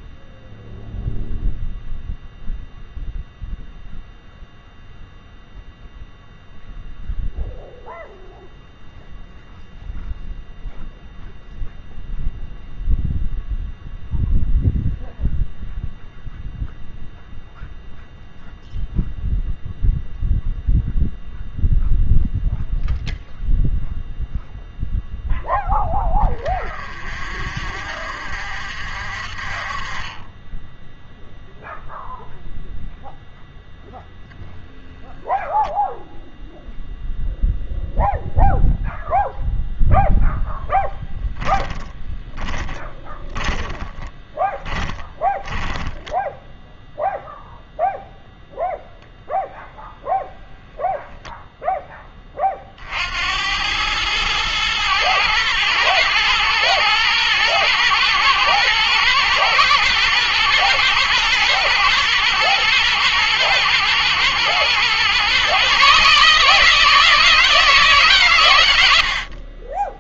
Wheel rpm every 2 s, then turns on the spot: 0, 0, 0, 0, 0, 0, 0, 0, 0, 0, 0, 0, 0, 30, 50, 10, 0, 0, 0, 0, 10, 10, 10, 0, 0, 0, 40, 110, 110, 120, 120, 110, 120, 160, 110.
40-46